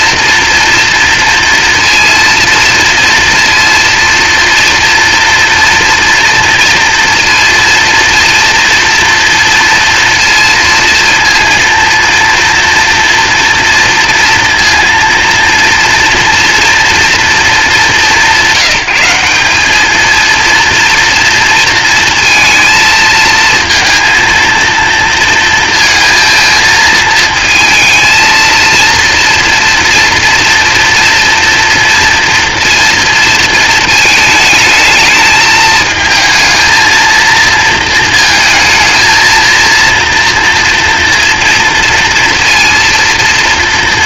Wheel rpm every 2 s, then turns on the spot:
230, 230, 230, 230, 230, 230, 230, 230, 230, 180, 230, 230, 230, 230, 230, 230, 230, 220, 230, 230, 240, 230.
none